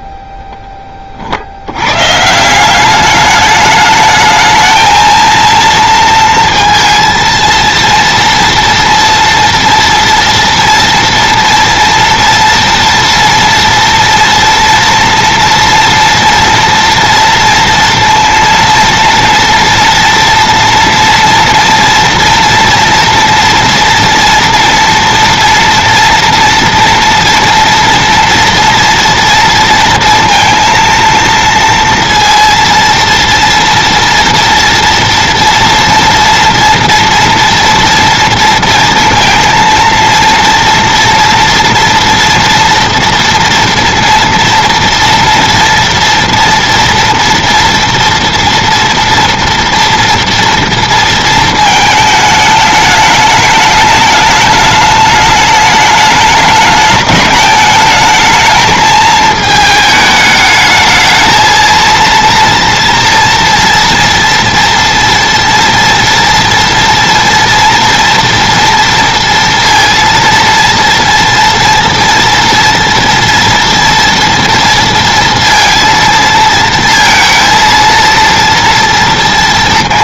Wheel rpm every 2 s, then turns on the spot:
10, 180, 220, 230, 230, 230, 230, 230, 230, 230, 230, 230, 240, 230, 230, 230, 230, 230, 240, 230, 230, 230, 230, 230, 230, 230, 210, 210, 210, 220, 220, 230, 230, 230, 230, 230, 230, 230, 230, 230.
none